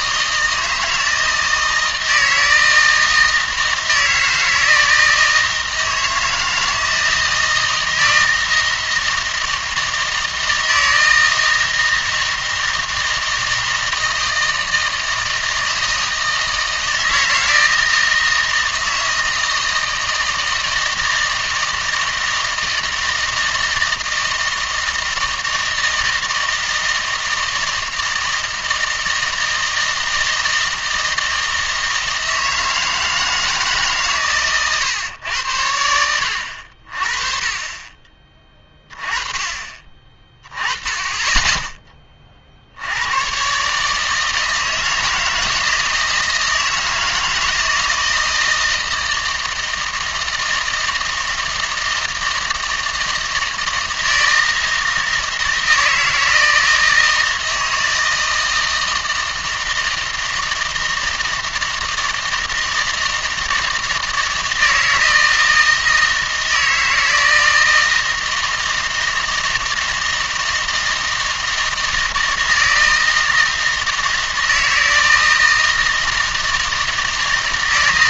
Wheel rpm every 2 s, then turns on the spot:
160, 160, 160, 160, 160, 160, 160, 160, 160, 160, 160, 160, 160, 160, 160, 160, 160, 130, 70, 20, 20, 50, 160, 160, 160, 160, 160, 160, 160, 160, 160, 160, 160, 160, 160, 160, 160, 160, 160.
none